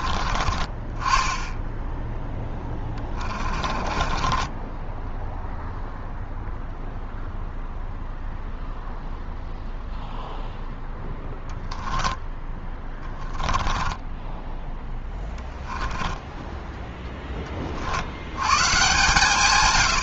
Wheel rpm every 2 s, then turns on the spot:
30, 10, 20, 0, 0, 0, 10, 10, 10, 110.
4-6 12-18